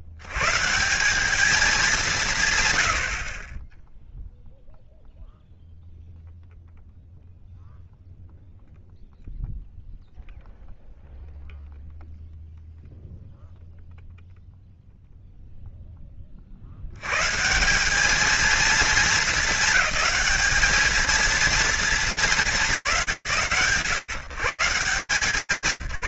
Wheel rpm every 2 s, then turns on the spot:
60, 160, 0, 0, 0, 0, 0, 0, 140, 200, 220, 150, 150.
none